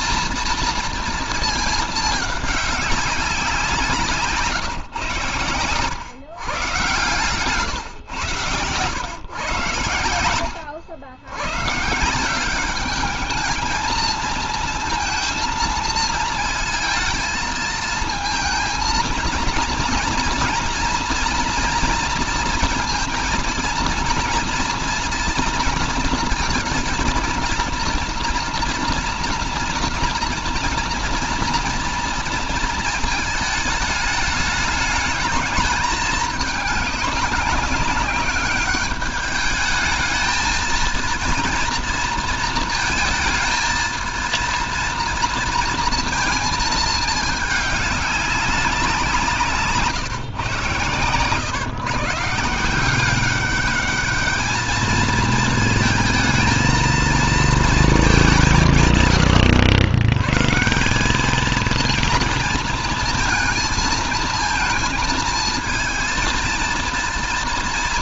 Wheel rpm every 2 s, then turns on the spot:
230, 200, 130, 130, 120, 90, 190, 230, 230, 230, 230, 230, 230, 230, 230, 240, 220, 210, 210, 200, 230, 230, 230, 220, 180, 140, 180, 220, 230, 150, 170, 230, 230, 230.
none